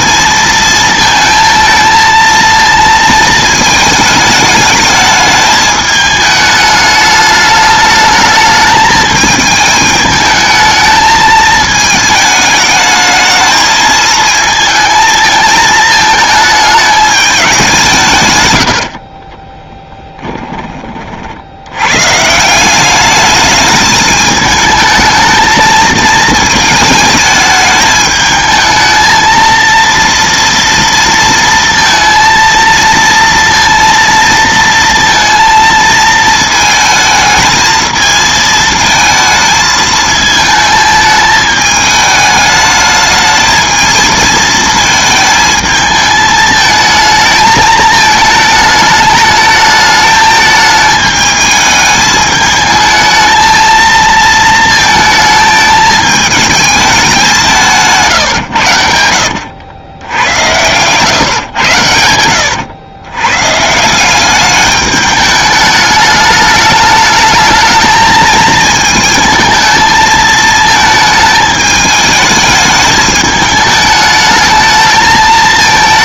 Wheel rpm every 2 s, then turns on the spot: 230, 230, 220, 210, 210, 220, 210, 220, 220, 100, 10, 170, 220, 220, 220, 230, 230, 230, 220, 220, 220, 210, 220, 220, 220, 220, 220, 220, 220, 110, 100, 100, 200, 210, 220, 220, 210, 220.
none